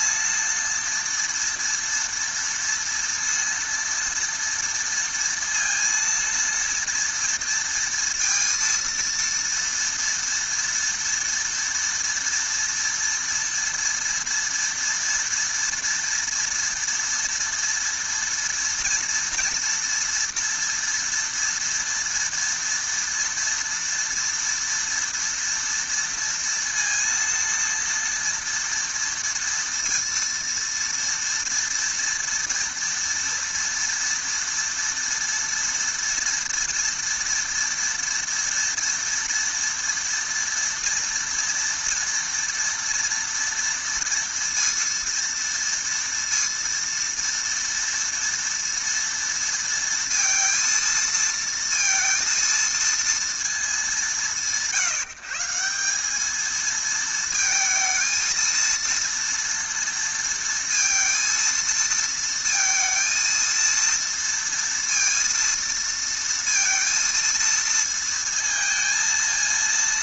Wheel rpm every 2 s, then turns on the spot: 230, 230, 230, 230, 230, 230, 230, 230, 230, 230, 230, 230, 230, 230, 230, 230, 230, 230, 230, 240, 230, 230, 230, 230, 230, 230, 230, 170, 220, 230, 230, 230, 230, 230, 220.
none